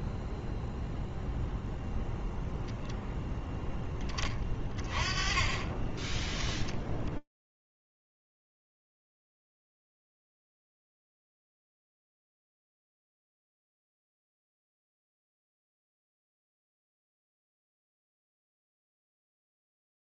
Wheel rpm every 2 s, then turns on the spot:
0, 0, 40, 20, 0, 10, 0, 10, 0, 10.
none